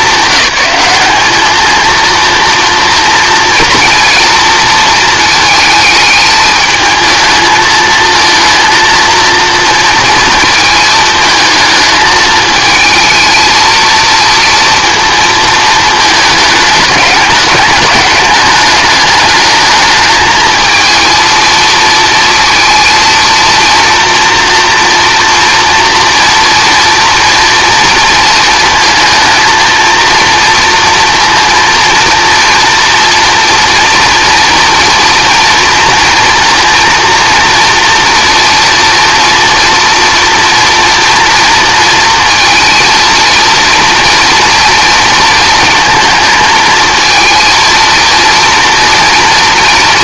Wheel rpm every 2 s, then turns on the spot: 190, 230, 230, 220, 230, 220, 220, 230, 220, 210, 220, 230, 230, 230, 230, 230, 230, 230, 230, 230, 230, 230, 230, 220, 230.
none